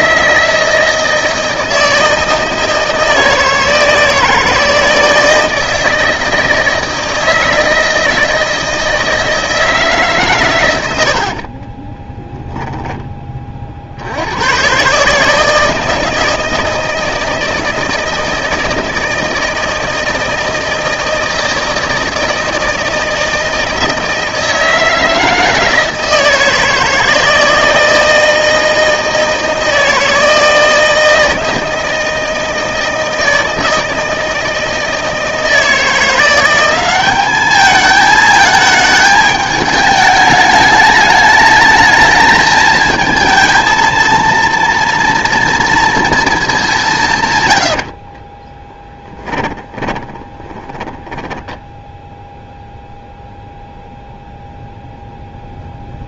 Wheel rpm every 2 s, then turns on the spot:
160, 160, 160, 160, 160, 110, 10, 120, 160, 160, 160, 160, 160, 160, 160, 160, 160, 160, 180, 220, 210, 220, 230, 200, 10, 10, 0, 0.
48-52